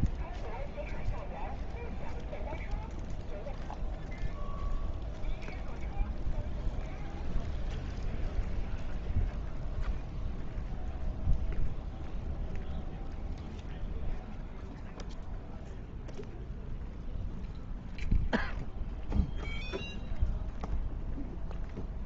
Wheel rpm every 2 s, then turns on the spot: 0, 0, 0, 0, 0, 0, 0, 0, 0, 0, 0.
none